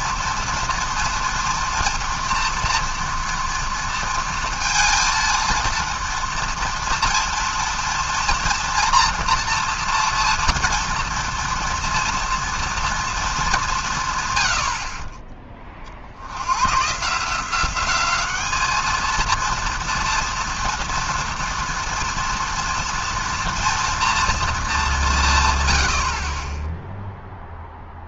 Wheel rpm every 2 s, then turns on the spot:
230, 230, 230, 230, 230, 230, 230, 80, 100, 210, 230, 230, 220, 10.
none